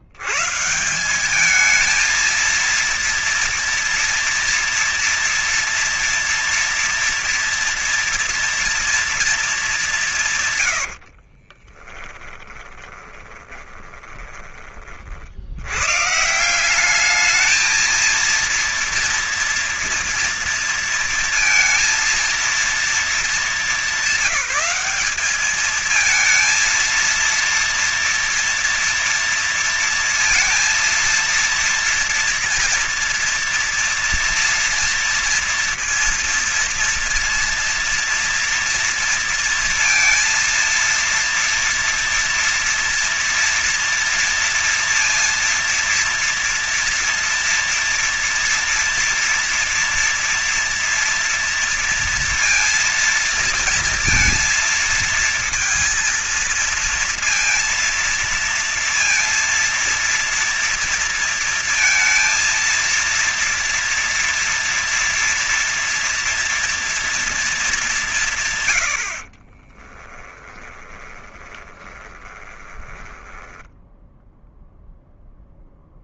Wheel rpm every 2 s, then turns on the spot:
120, 220, 230, 230, 230, 140, 10, 20, 160, 230, 230, 230, 200, 220, 230, 230, 230, 230, 230, 230, 230, 230, 230, 230, 230, 230, 230, 230, 230, 230, 230, 230, 230, 230, 160, 10, 20, 0.
10-14 70-74